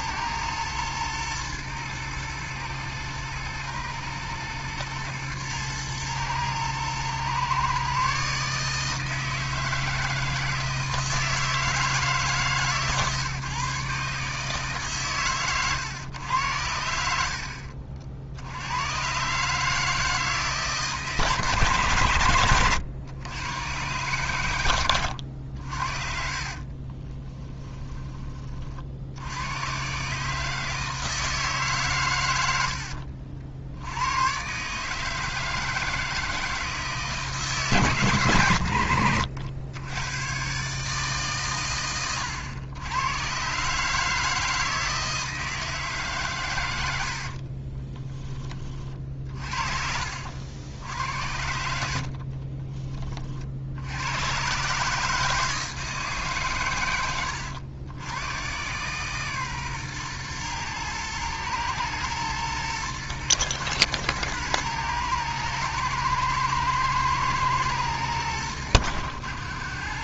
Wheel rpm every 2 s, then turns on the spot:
110, 110, 110, 120, 150, 160, 140, 150, 100, 90, 150, 120, 100, 30, 50, 160, 60, 150, 160, 110, 140, 100, 160, 90, 30, 80, 20, 150, 110, 130, 120, 120, 110, 110, 80.
26-28